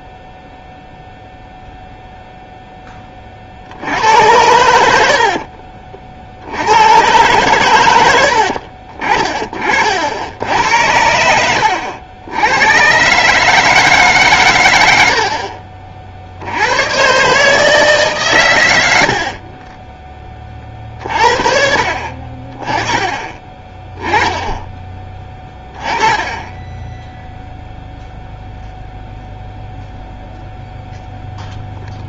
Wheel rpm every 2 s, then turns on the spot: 0, 10, 90, 90, 60, 80, 100, 110, 90, 100, 30, 30, 10, 10, 0, 0.
4-6 8-10